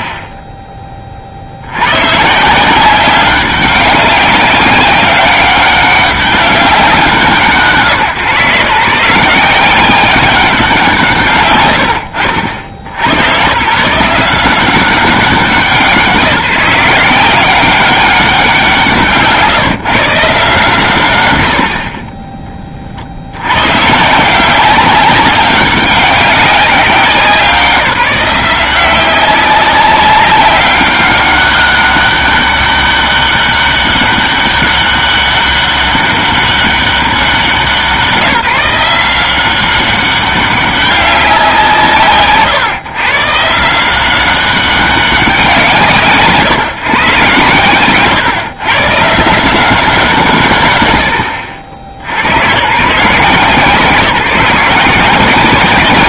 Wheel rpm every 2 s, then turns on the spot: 10, 170, 190, 190, 150, 170, 110, 190, 170, 160, 150, 20, 190, 190, 190, 200, 200, 200, 190, 170, 190, 150, 190, 140, 130, 80, 140, 180.
none